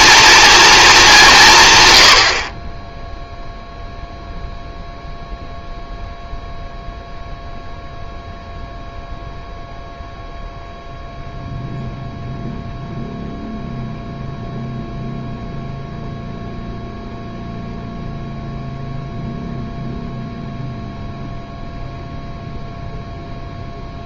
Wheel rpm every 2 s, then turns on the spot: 220, 20, 0, 0, 0, 0, 0, 0, 0, 0, 0, 0.
none